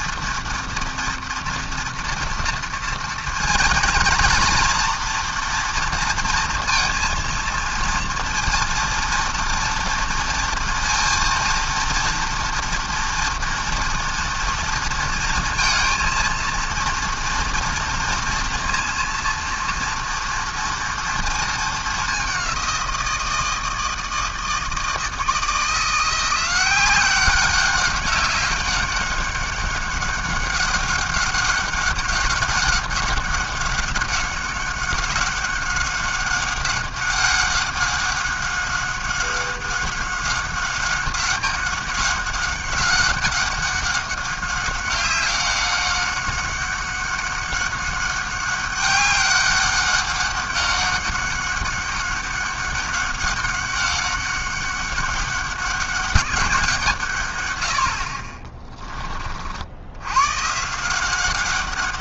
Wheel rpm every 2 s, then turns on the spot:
240, 230, 240, 230, 230, 230, 230, 230, 230, 230, 230, 180, 160, 180, 200, 190, 190, 190, 190, 200, 190, 200, 190, 190, 200, 200, 190, 200, 170, 20, 160.
none